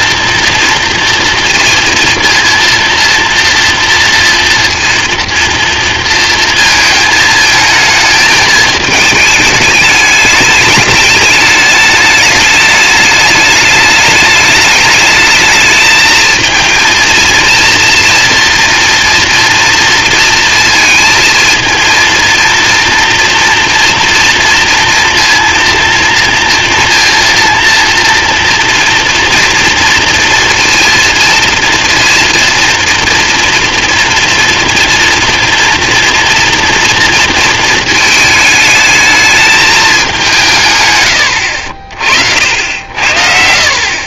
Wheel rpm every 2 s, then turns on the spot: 230, 230, 240, 230, 210, 210, 210, 210, 220, 230, 230, 230, 240, 230, 240, 230, 230, 240, 230, 220, 140, 80.
none